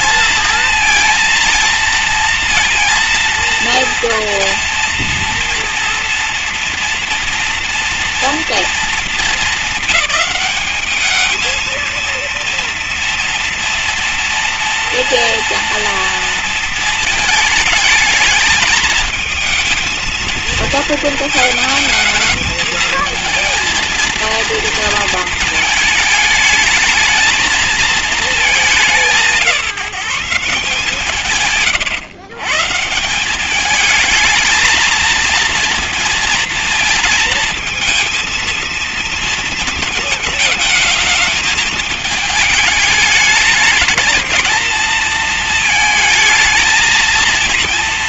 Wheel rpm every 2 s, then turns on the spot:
230, 230, 230, 230, 220, 200, 230, 230, 230, 230, 220, 220, 230, 220, 190, 160, 150, 220, 230, 230, 220, 210, 220, 230.
none